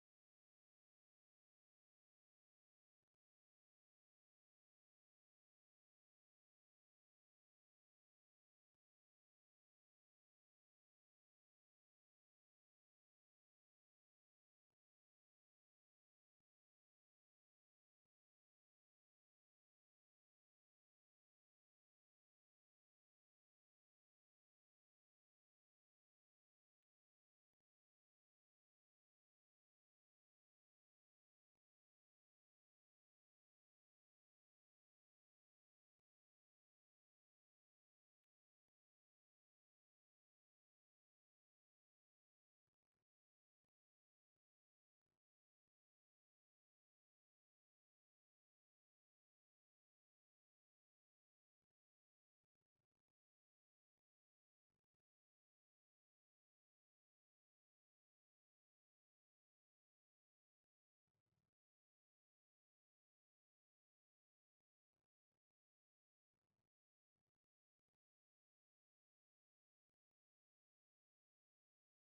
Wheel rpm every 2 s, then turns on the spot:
0, 0, 0, 0, 0, 0, 0, 0, 0, 0, 0, 0, 0, 0, 0, 0, 0, 0, 0, 0, 0, 0, 0, 0, 0, 0, 0, 0, 0, 0, 0, 0, 0, 0, 0, 0.
none